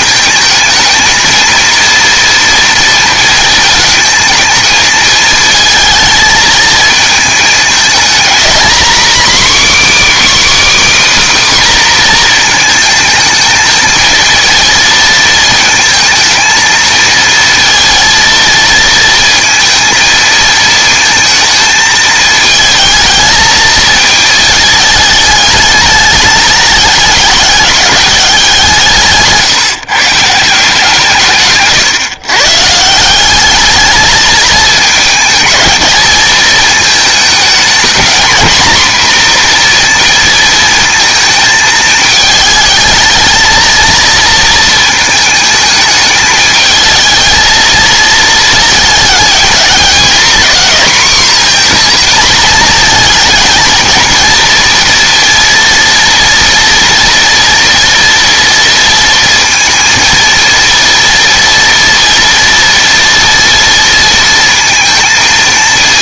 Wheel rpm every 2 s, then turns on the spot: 220, 230, 220, 220, 240, 300, 220, 230, 230, 230, 230, 220, 220, 210, 170, 160, 150, 220, 220, 240, 230, 220, 230, 220, 230, 260, 230, 230, 230, 230, 230, 230, 230.
none